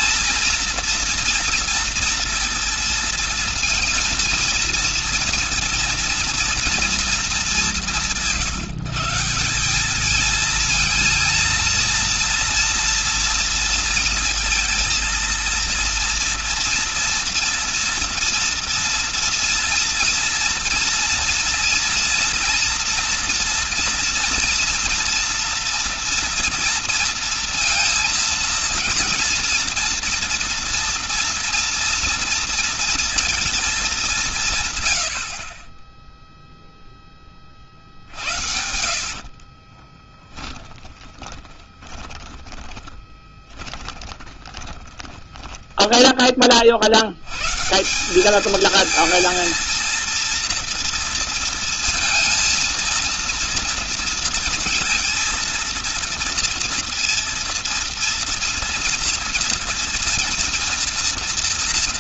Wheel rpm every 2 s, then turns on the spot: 230, 230, 230, 230, 160, 230, 240, 230, 230, 230, 230, 230, 230, 230, 230, 230, 230, 160, 0, 60, 10, 10, 20, 40, 210, 230, 230, 230, 230, 230, 230.
38-46